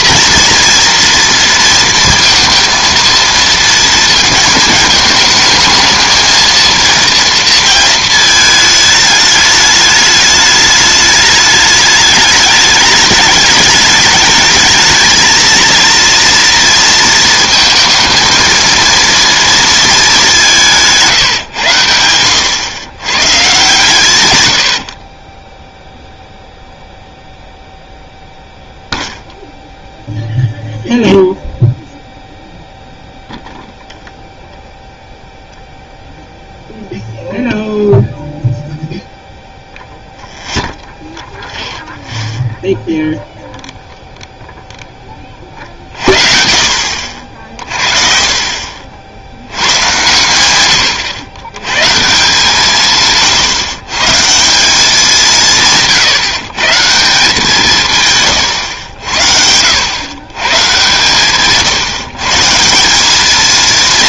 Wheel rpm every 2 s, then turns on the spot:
230, 230, 220, 230, 220, 210, 210, 220, 230, 230, 190, 100, 100, 0, 0, 0, 0, 0, 0, 0, 0, 0, 0, 50, 50, 110, 150, 170, 140, 120, 120, 160.
none